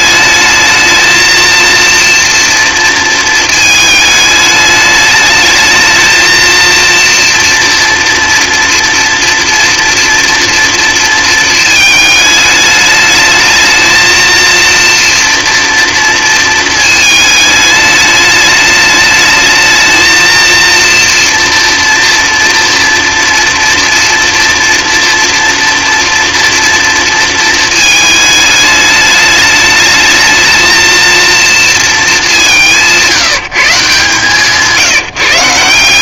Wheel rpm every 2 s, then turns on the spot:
220, 230, 210, 230, 230, 230, 210, 230, 230, 210, 230, 240, 230, 230, 210, 220, 190, 160.
none